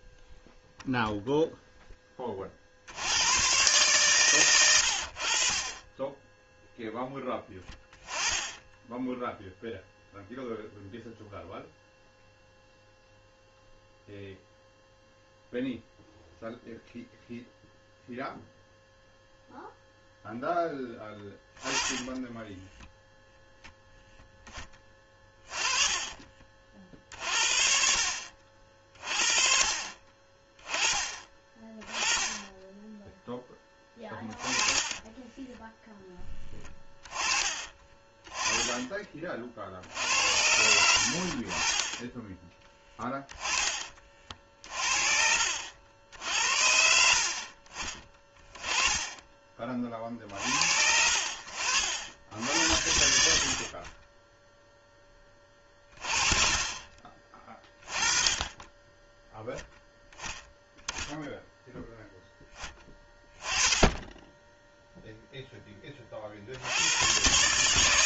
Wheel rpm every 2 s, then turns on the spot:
0, 40, 100, 0, 10, 0, 0, 0, 0, 0, 0, 0, 10, 40, 50, 20, 10, 20, 10, 20, 80, 10, 40, 80, 30, 60, 80, 0, 30, 20, 20, 10, 10, 70.
34-36 38-40 42-50